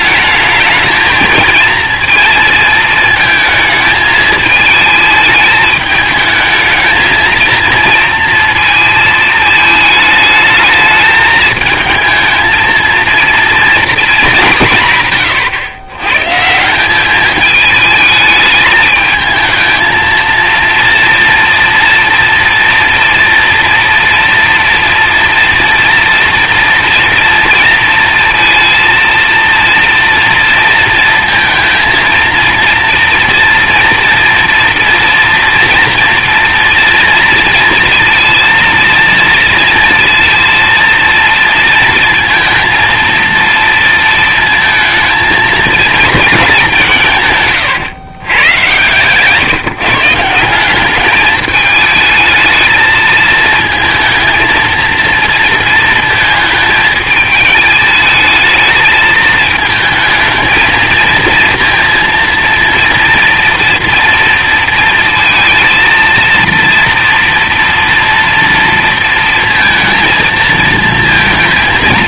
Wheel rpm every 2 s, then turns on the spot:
220, 230, 220, 220, 230, 220, 230, 200, 160, 220, 230, 240, 230, 230, 230, 230, 230, 230, 230, 230, 230, 230, 230, 200, 120, 180, 220, 230, 220, 220, 230, 230, 230, 230, 230, 230.
none